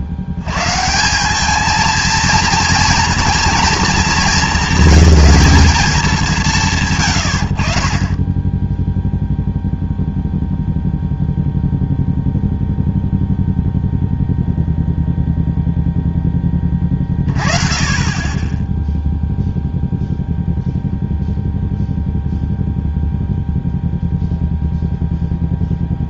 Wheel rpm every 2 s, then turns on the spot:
110, 230, 210, 130, 10, 0, 0, 0, 20, 10, 0, 0, 0.
none